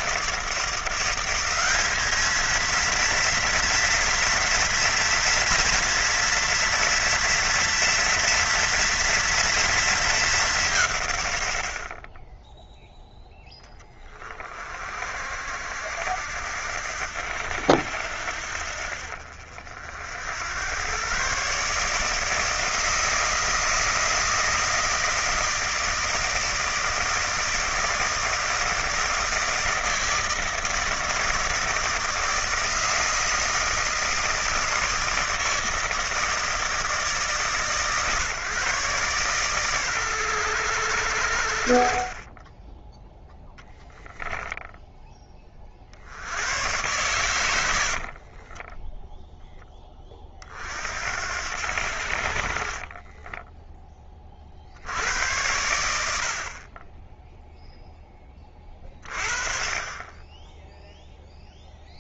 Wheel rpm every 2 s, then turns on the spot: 170, 230, 230, 230, 230, 160, 0, 40, 80, 60, 110, 160, 160, 160, 160, 160, 160, 160, 150, 130, 100, 10, 10, 100, 30, 60, 40, 60, 20, 30, 0.
48-50 52-54